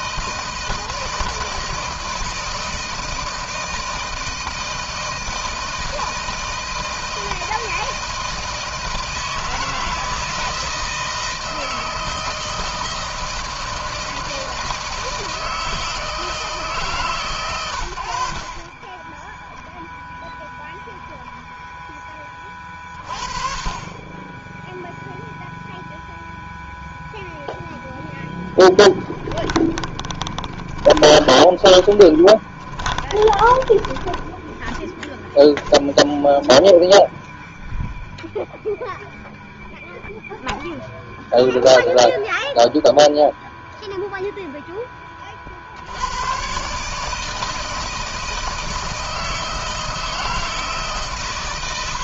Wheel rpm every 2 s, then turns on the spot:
160, 160, 160, 160, 160, 160, 160, 160, 140, 30, 0, 30, 0, 0, 0, 20, 20, 10, 0, 0, 0, 0, 10, 140, 160, 150.
18-20 30-34